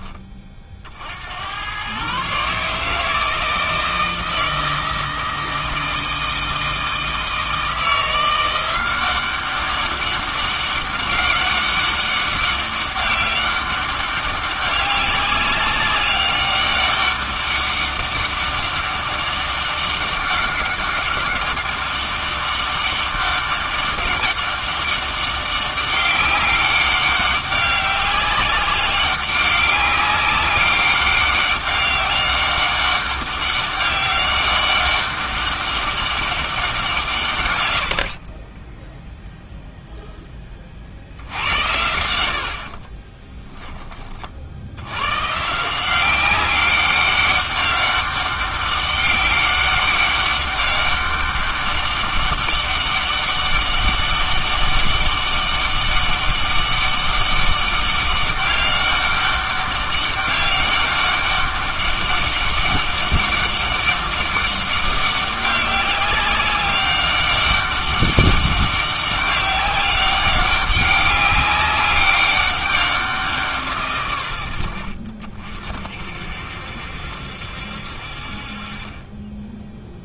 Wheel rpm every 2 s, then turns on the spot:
50, 150, 160, 160, 180, 200, 200, 190, 200, 200, 200, 200, 200, 200, 190, 200, 200, 200, 180, 10, 50, 40, 80, 200, 190, 200, 200, 200, 200, 200, 200, 200, 200, 200, 200, 200, 190, 70, 70, 40.
38-40 42-44